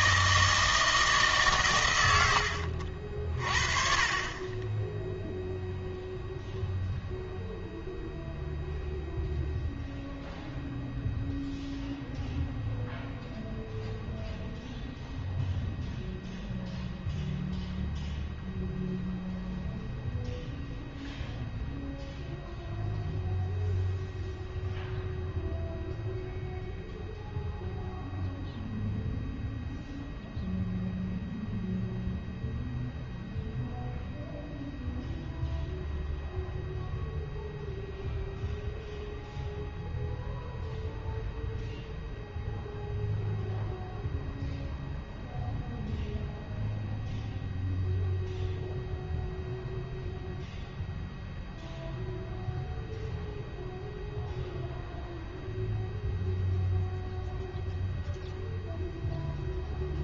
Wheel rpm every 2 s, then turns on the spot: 160, 70, 20, 0, 0, 0, 0, 0, 0, 0, 0, 0, 0, 0, 0, 0, 0, 0, 0, 0, 0, 0, 0, 0, 0, 0, 0, 0, 0, 0.
none